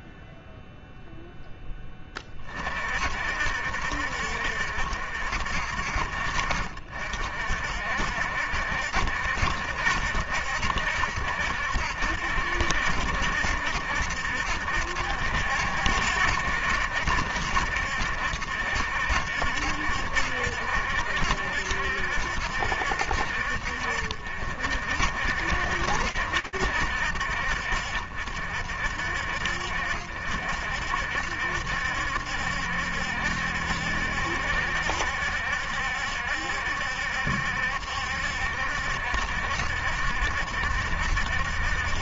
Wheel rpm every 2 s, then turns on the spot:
0, 40, 70, 60, 70, 70, 70, 70, 70, 70, 60, 60, 60, 60, 60, 60, 70, 70, 70, 70, 60.
none